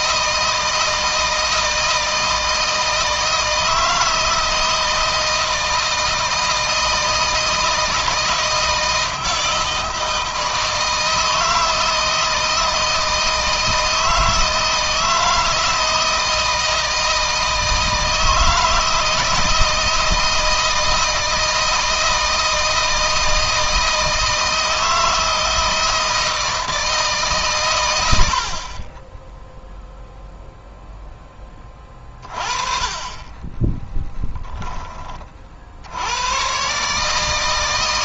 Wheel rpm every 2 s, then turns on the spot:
160, 160, 160, 160, 160, 160, 160, 160, 170, 160, 160, 160, 160, 160, 50, 0, 30, 10, 120.
none